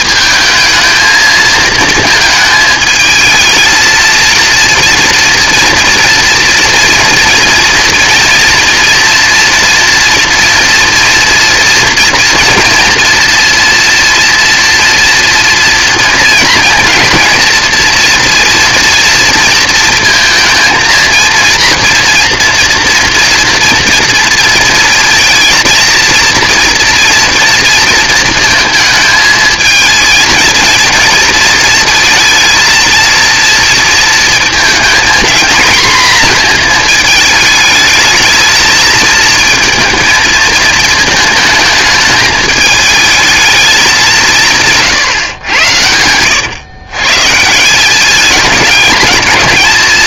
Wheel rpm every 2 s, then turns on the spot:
220, 220, 230, 230, 230, 230, 230, 240, 230, 230, 230, 230, 230, 230, 230, 230, 230, 220, 230, 220, 220, 220, 170, 110, 210.
none